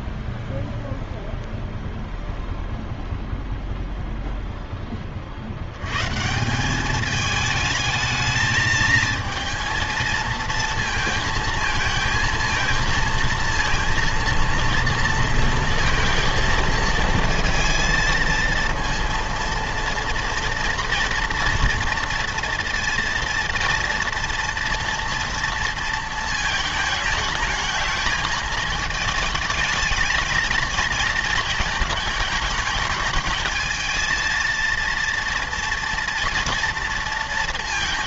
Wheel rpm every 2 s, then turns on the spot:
0, 0, 10, 190, 220, 220, 220, 230, 230, 230, 230, 230, 230, 220, 220, 230, 210, 230, 230.
none